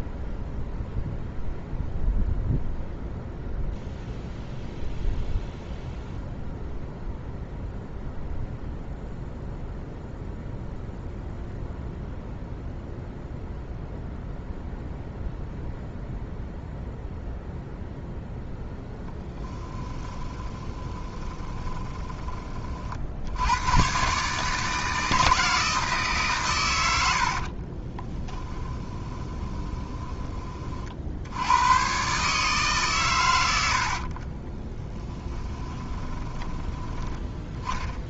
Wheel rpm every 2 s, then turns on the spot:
0, 0, 0, 0, 0, 0, 0, 0, 0, 0, 20, 40, 160, 110, 10, 50, 140, 20, 10.
20-22 28-30 34-36